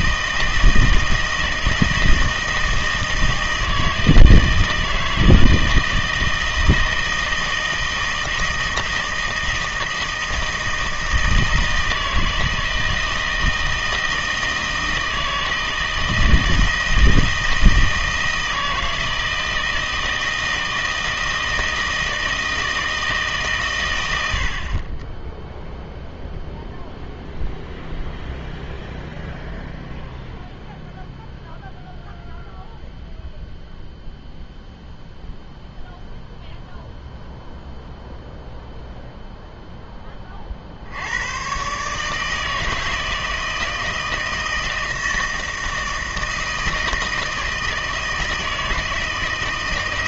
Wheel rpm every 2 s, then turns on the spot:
160, 160, 160, 160, 160, 160, 160, 160, 160, 160, 160, 160, 40, 0, 0, 0, 0, 0, 0, 0, 60, 160, 160, 160, 160.
none